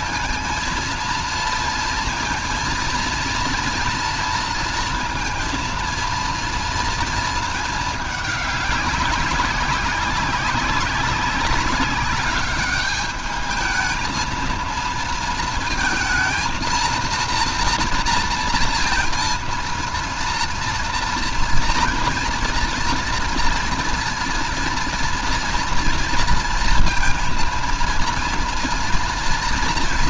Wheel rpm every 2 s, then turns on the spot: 230, 230, 230, 230, 200, 190, 200, 230, 220, 230, 230, 230, 230, 230, 240.
none